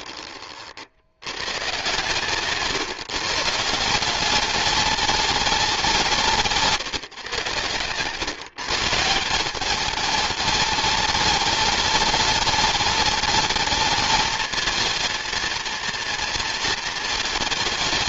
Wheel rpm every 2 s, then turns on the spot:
50, 140, 200, 150, 150, 210, 210, 220, 230.
none